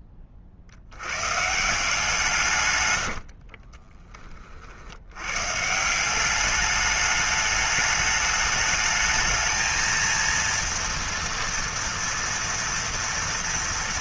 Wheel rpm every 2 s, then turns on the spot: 50, 120, 50, 200, 210, 230, 230.
2-4